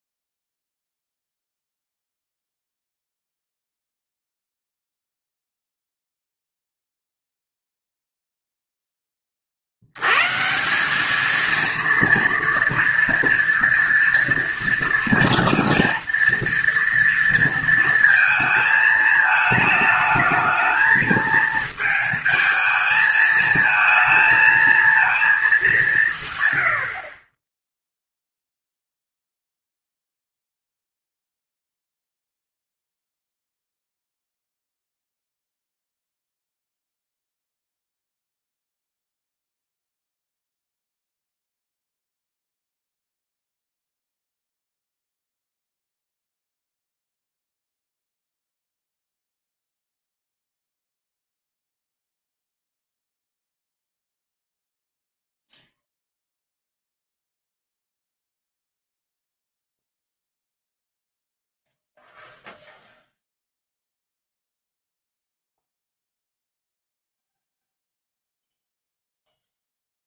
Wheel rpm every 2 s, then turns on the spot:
0, 0, 0, 0, 0, 160, 230, 230, 230, 220, 220, 220, 220, 100, 0, 0, 0, 0, 0, 0, 0, 0, 0, 0, 0, 0, 0, 0, 0, 0, 0, 0, 0, 0, 0.
none